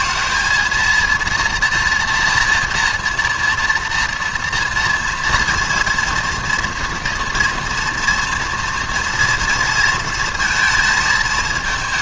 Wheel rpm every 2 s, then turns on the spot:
220, 230, 230, 240, 230, 220.
none